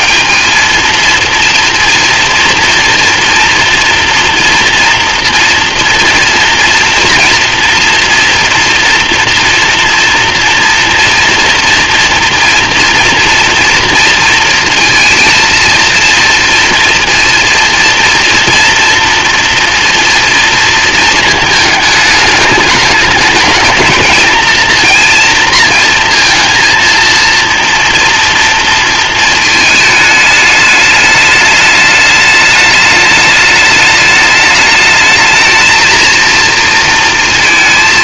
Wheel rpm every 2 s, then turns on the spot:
230, 230, 230, 240, 240, 230, 230, 230, 230, 230, 230, 210, 230, 230, 230, 210, 210, 210, 230.
none